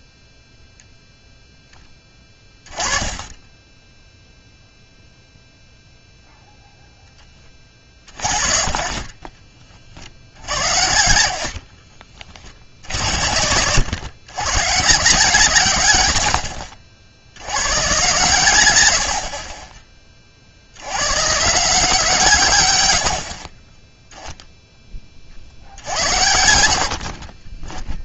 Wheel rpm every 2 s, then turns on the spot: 0, 20, 0, 0, 40, 70, 70, 140, 60, 100, 80, 100, 10, 60.
10-12 18-20 22-24 26-28